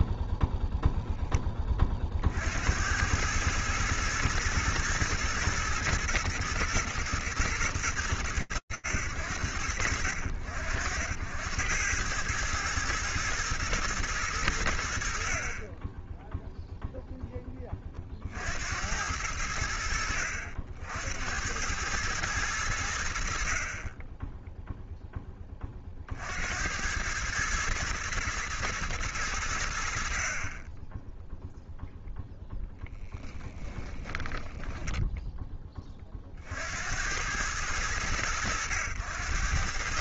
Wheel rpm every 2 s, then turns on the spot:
30, 120, 120, 100, 60, 80, 110, 60, 0, 70, 100, 40, 30, 110, 70, 0, 10, 30, 100, 100.
32-34